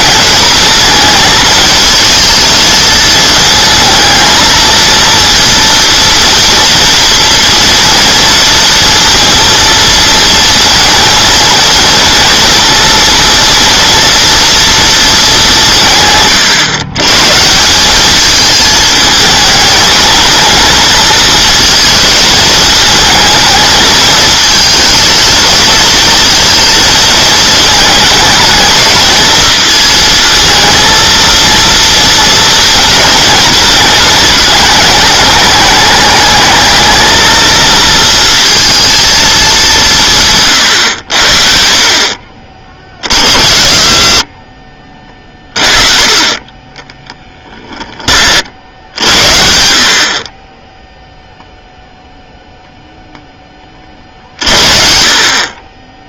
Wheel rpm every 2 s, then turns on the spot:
210, 220, 230, 230, 230, 220, 230, 230, 130, 220, 220, 220, 220, 220, 220, 230, 230, 210, 220, 230, 110, 30, 30, 10, 70, 10, 0, 40.
42-48